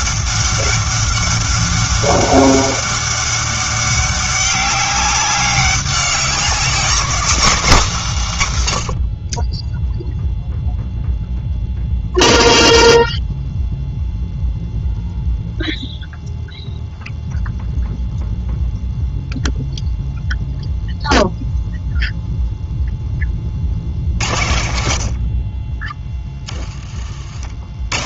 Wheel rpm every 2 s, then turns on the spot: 200, 190, 200, 200, 100, 0, 0, 0, 0, 0, 0, 10, 70, 30.
none